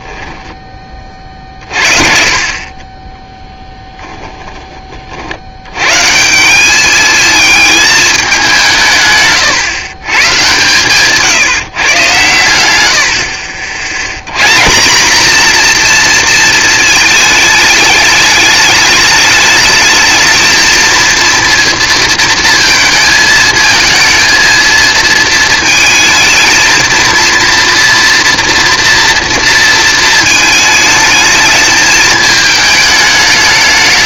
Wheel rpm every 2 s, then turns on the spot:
10, 50, 20, 180, 190, 130, 120, 120, 230, 210, 220, 230, 230, 230, 230, 220, 220.
4-6